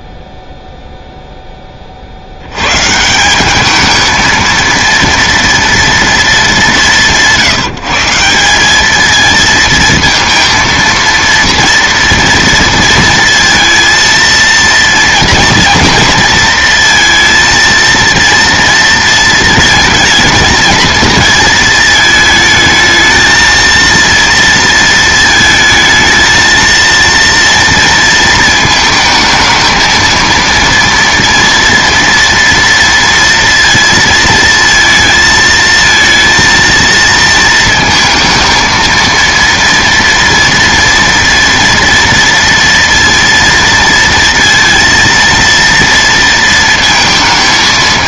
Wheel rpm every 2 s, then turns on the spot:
0, 100, 230, 210, 190, 230, 230, 230, 230, 230, 230, 220, 230, 230, 220, 230, 230, 230, 230, 230, 240, 230, 230, 230.
none